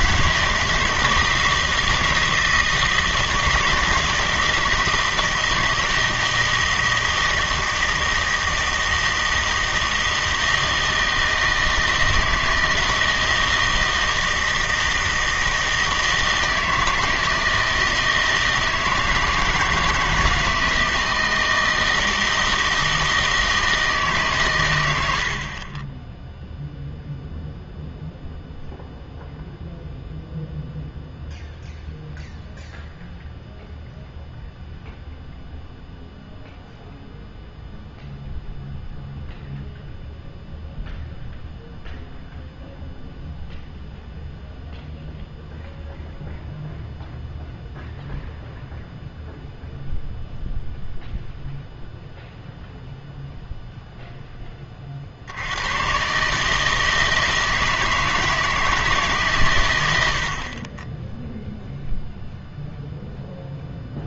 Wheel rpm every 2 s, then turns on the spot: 160, 160, 160, 160, 160, 160, 160, 160, 160, 160, 160, 160, 110, 0, 0, 0, 0, 0, 0, 0, 0, 0, 0, 0, 0, 0, 0, 20, 150, 160, 30, 0.
none